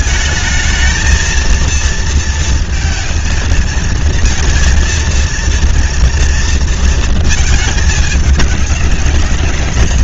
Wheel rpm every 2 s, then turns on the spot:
220, 230, 230, 230, 210.
none